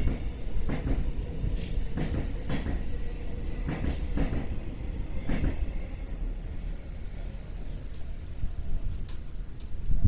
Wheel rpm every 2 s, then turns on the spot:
0, 0, 0, 0, 0.
none